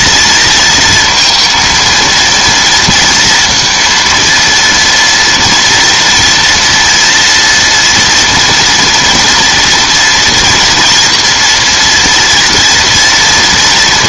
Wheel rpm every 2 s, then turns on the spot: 230, 230, 230, 230, 230, 230, 240.
none